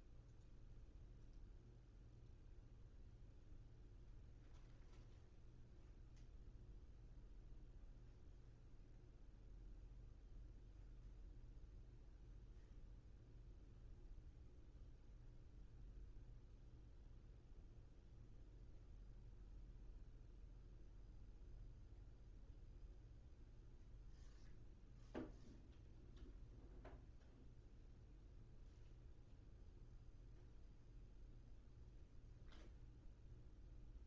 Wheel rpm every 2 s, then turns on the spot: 0, 0, 0, 0, 0, 0, 0, 0, 0, 0, 0, 0, 0, 0, 0, 0, 0.
none